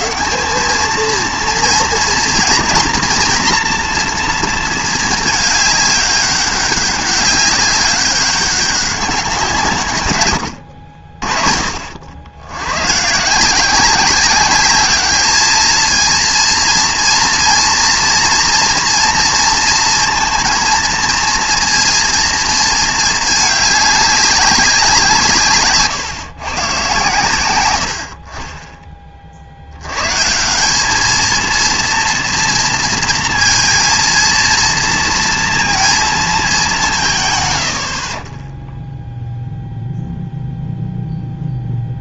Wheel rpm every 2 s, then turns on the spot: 190, 230, 230, 200, 200, 100, 100, 200, 230, 230, 230, 220, 190, 130, 40, 180, 230, 230, 210, 20, 0.
none